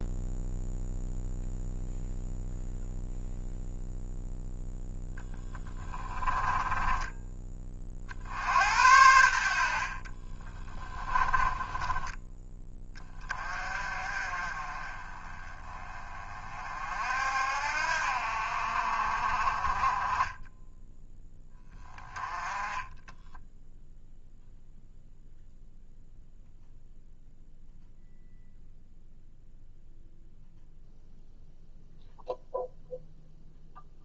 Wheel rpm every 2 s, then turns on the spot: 0, 0, 0, 10, 80, 20, 20, 30, 50, 50, 10, 10, 0, 0, 0, 0, 0.
6-8 10-12